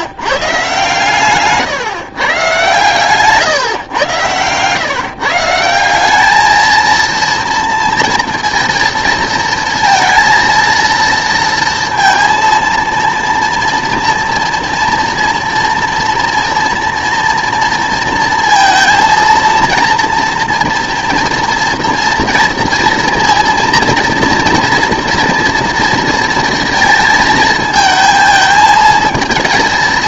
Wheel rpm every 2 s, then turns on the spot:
140, 130, 120, 220, 230, 230, 230, 230, 230, 230, 240, 240, 230, 230, 220.
none